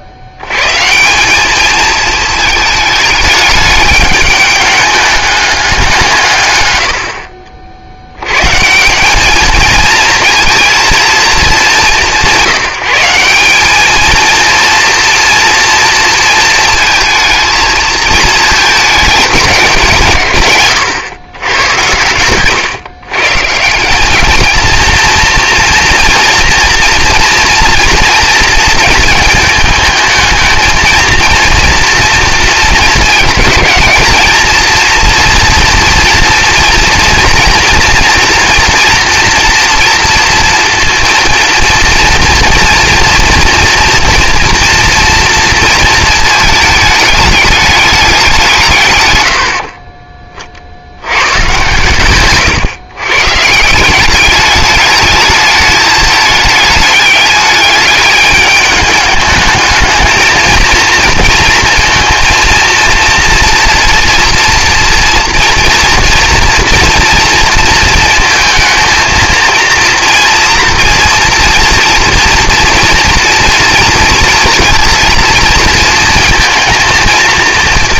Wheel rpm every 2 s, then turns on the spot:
100, 220, 210, 110, 140, 230, 180, 230, 220, 220, 120, 120, 220, 230, 220, 220, 220, 220, 230, 240, 230, 230, 230, 220, 180, 50, 120, 210, 210, 210, 230, 230, 230, 230, 220, 230, 230, 230, 220.
none